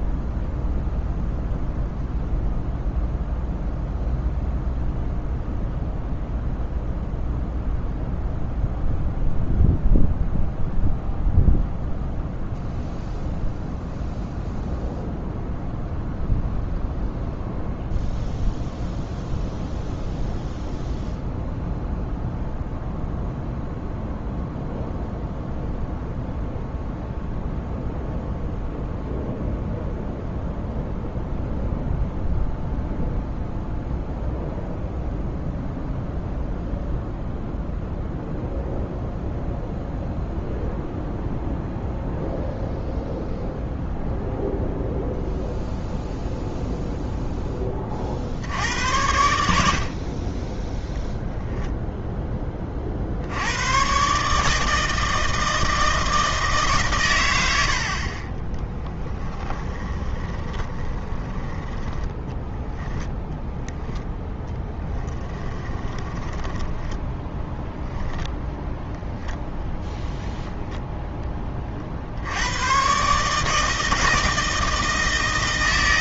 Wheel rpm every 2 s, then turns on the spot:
0, 0, 0, 0, 0, 0, 0, 0, 0, 0, 0, 0, 0, 0, 0, 0, 0, 0, 0, 0, 0, 0, 0, 0, 70, 10, 30, 150, 150, 10, 20, 10, 10, 10, 0, 0, 110, 160.
58-68